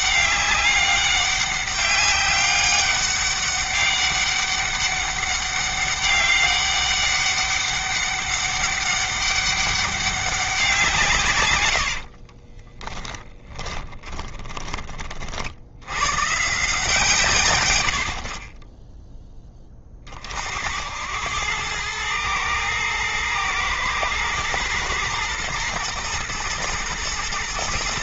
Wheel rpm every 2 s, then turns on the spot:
200, 200, 200, 200, 200, 160, 20, 40, 150, 10, 80, 110, 120, 110.
12-14 18-20